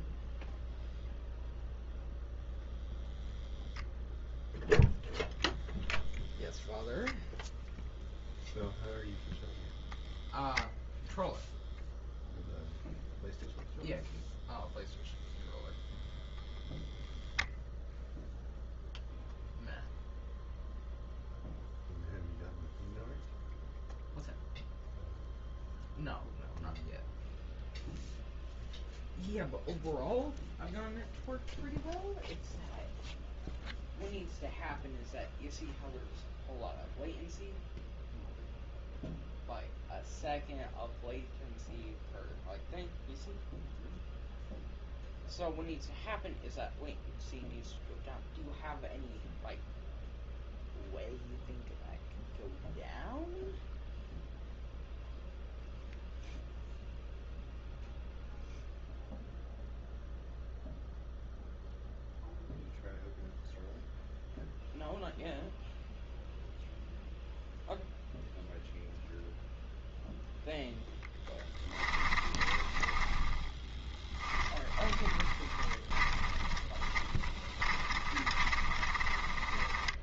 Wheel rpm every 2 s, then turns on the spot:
0, 0, 0, 0, 0, 0, 0, 0, 0, 0, 0, 0, 0, 0, 0, 0, 0, 0, 0, 0, 0, 0, 0, 0, 0, 0, 0, 0, 0, 0, 0, 0, 0, 0, 0, 0, 20, 20, 20, 30.
72-80